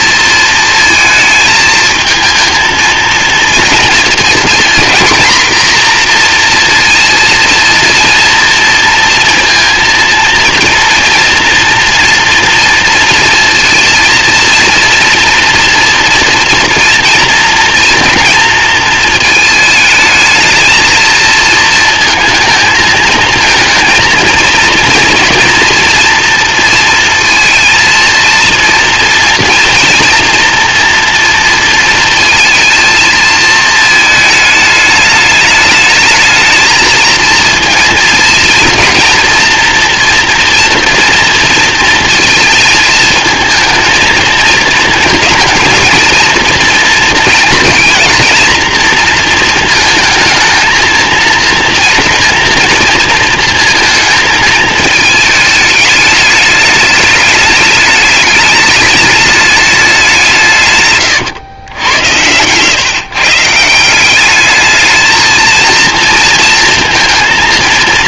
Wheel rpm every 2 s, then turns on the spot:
220, 230, 230, 230, 230, 230, 230, 230, 240, 230, 220, 220, 230, 230, 230, 230, 230, 210, 220, 230, 240, 220, 220, 230, 230, 230, 230, 220, 210, 210, 150, 120, 210, 230.
none